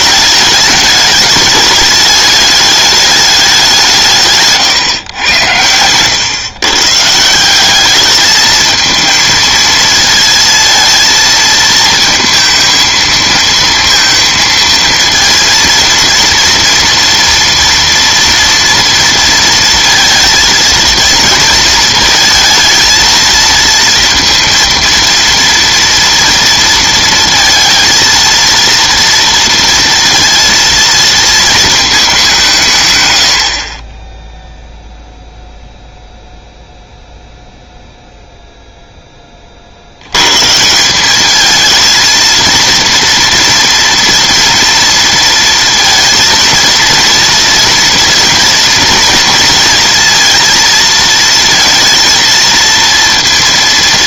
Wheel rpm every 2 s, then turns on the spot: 210, 210, 140, 140, 220, 220, 220, 230, 230, 230, 220, 230, 230, 230, 230, 230, 150, 0, 0, 0, 160, 230, 230, 230, 230, 220, 230.
4-6